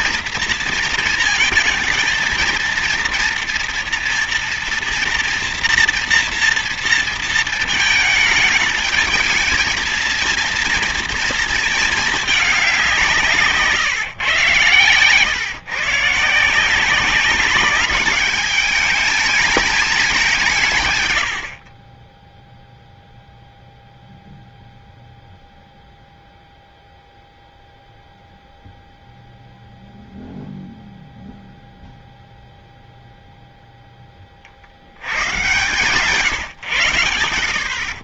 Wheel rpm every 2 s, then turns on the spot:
230, 230, 230, 230, 220, 230, 210, 140, 160, 210, 170, 0, 0, 0, 0, 0, 0, 50, 140.
none